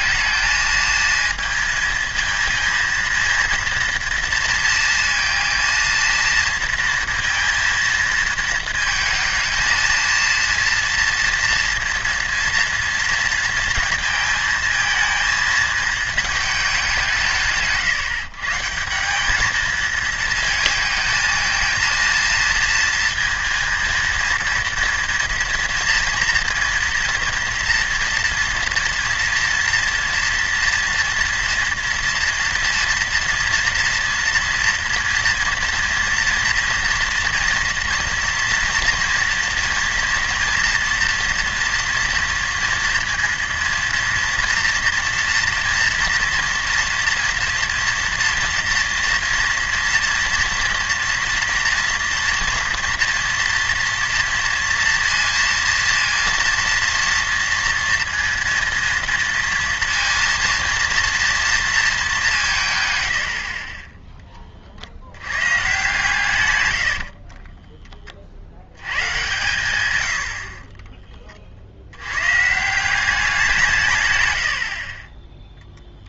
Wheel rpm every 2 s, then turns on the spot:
220, 230, 230, 230, 220, 230, 230, 220, 200, 160, 220, 230, 230, 230, 230, 230, 230, 230, 230, 230, 230, 230, 230, 230, 230, 230, 240, 230, 230, 230, 230, 140, 40, 100, 70, 40, 160, 50.
66-68 74-76